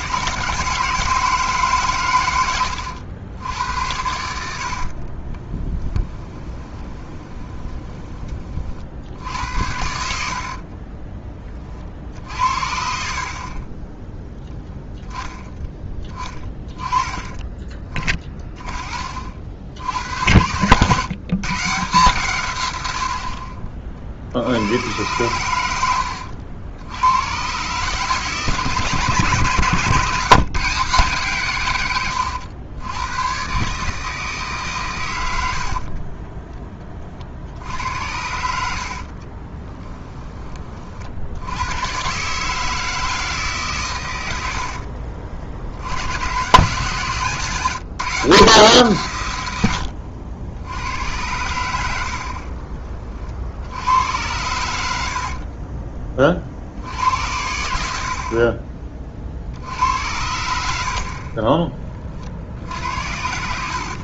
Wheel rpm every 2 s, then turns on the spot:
150, 90, 60, 20, 50, 40, 60, 10, 20, 30, 120, 100, 90, 90, 150, 160, 100, 140, 20, 60, 30, 160, 60, 130, 140, 90, 30, 90, 60, 30, 70, 60.
4-8 10-12 38-40 44-46 52-54 62-64